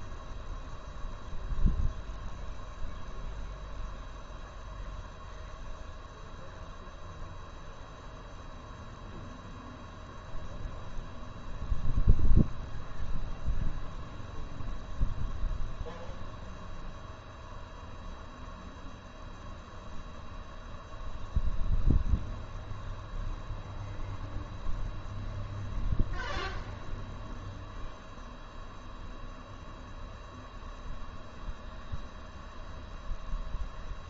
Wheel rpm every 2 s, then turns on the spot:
0, 0, 0, 0, 0, 0, 0, 0, 0, 0, 0, 0, 0, 0, 0, 0, 0.
none